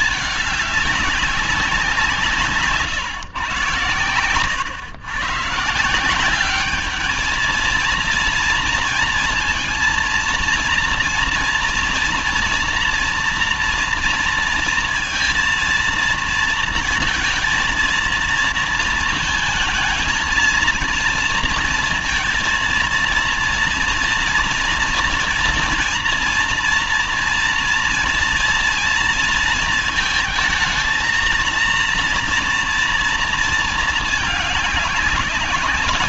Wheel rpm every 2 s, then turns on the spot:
210, 140, 110, 200, 230, 230, 230, 230, 230, 230, 230, 230, 230, 230, 230, 220, 230, 200.
none